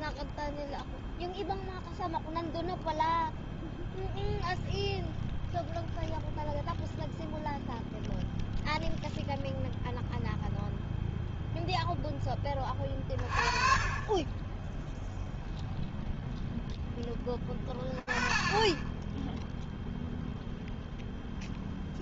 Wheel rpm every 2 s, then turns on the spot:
0, 0, 0, 0, 0, 0, 20, 0, 20, 0, 0.
none